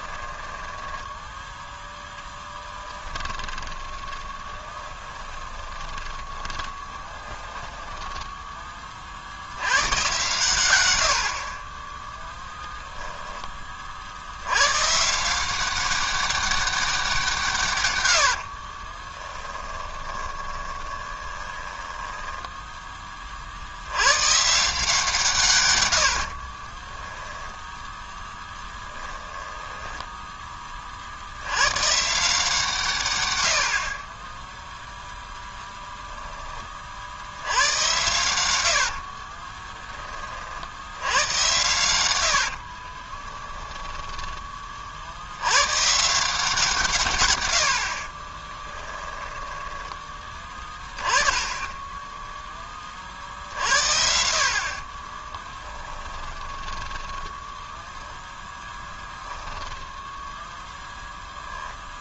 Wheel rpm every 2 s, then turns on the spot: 10, 10, 20, 20, 20, 110, 0, 120, 190, 40, 30, 10, 160, 20, 10, 30, 140, 0, 50, 70, 80, 50, 40, 150, 10, 20, 20, 40, 10, 20, 0.
0-8 18-22 26-30 38-40 42-44 48-50 54-60